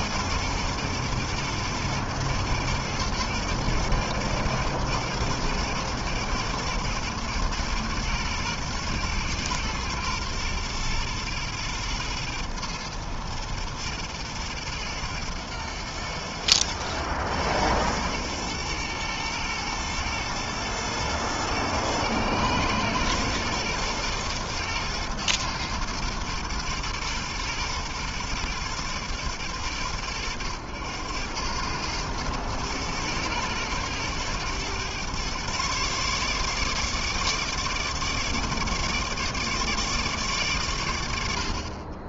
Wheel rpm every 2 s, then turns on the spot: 120, 120, 120, 120, 110, 110, 110, 110, 110, 110, 110, 120, 110, 110, 100, 100, 110, 130, 150, 150, 70.
none